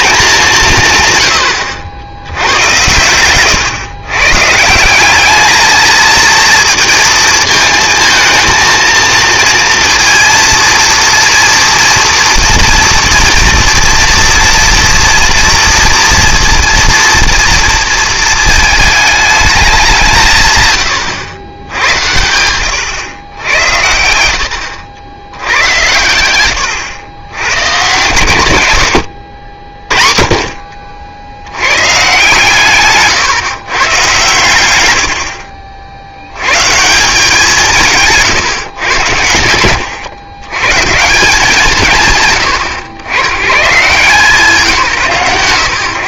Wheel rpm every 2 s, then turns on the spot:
180, 110, 150, 230, 230, 230, 230, 230, 230, 220, 130, 110, 80, 110, 120, 50, 140, 110, 130, 130, 110, 130, 160.
none